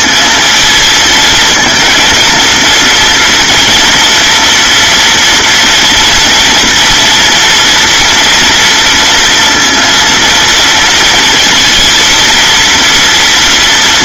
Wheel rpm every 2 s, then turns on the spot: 220, 230, 230, 230, 230, 230, 230.
none